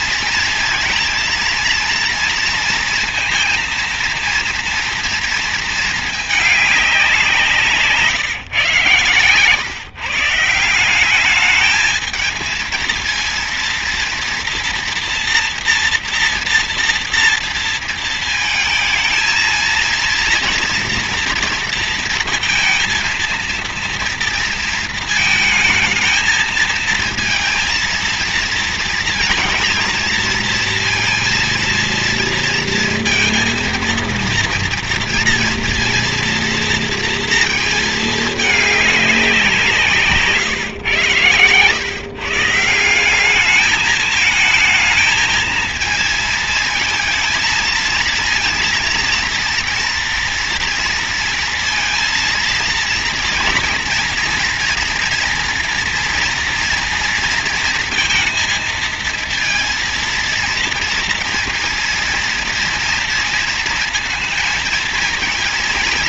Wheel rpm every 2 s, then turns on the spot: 230, 230, 230, 180, 140, 190, 230, 230, 230, 230, 230, 230, 220, 230, 230, 230, 230, 230, 230, 190, 110, 180, 220, 230, 230, 230, 230, 240, 230, 230, 230, 230, 230.
none